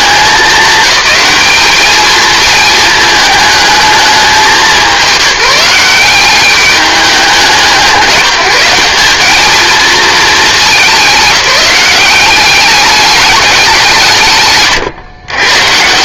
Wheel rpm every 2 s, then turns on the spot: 200, 220, 180, 200, 190, 190, 200, 130.
14-16